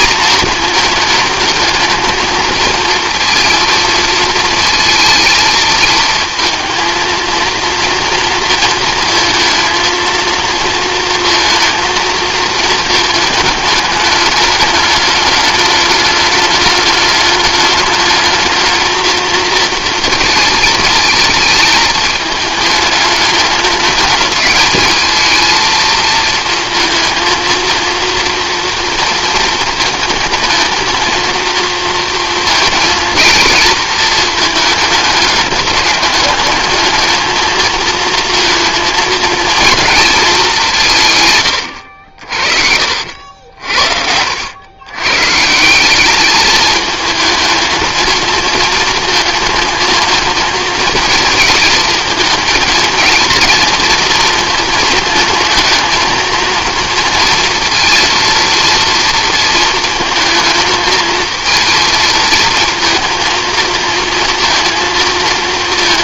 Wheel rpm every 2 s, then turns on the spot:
220, 220, 230, 230, 230, 230, 220, 210, 210, 220, 220, 220, 210, 220, 230, 230, 230, 210, 210, 230, 180, 60, 100, 220, 230, 230, 230, 220, 230, 230, 220, 220, 230.
none